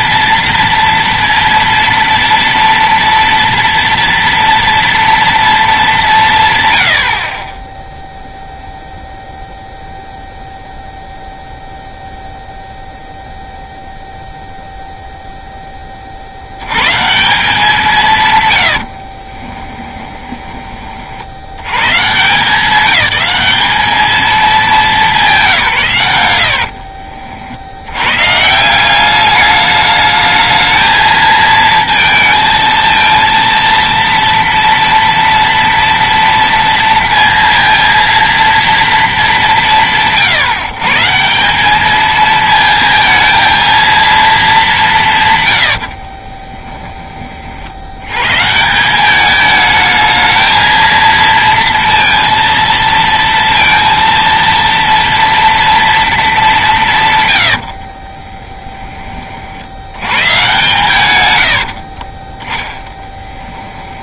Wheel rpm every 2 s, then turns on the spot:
230, 230, 230, 90, 0, 0, 0, 0, 140, 60, 30, 190, 190, 60, 180, 220, 230, 230, 230, 230, 150, 220, 200, 20, 180, 230, 230, 230, 180, 20, 130, 10.
18-20 26-28 46-48